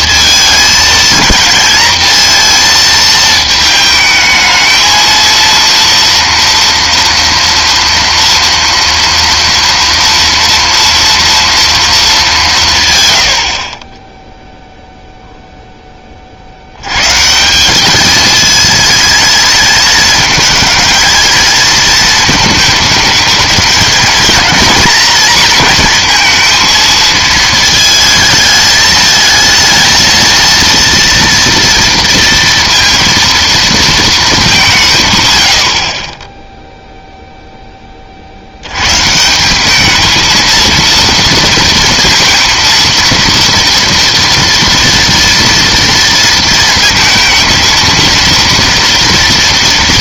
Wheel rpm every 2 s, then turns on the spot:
220, 220, 220, 230, 230, 230, 130, 0, 80, 220, 220, 220, 230, 230, 220, 230, 230, 190, 0, 80, 230, 230, 240, 230, 230.
none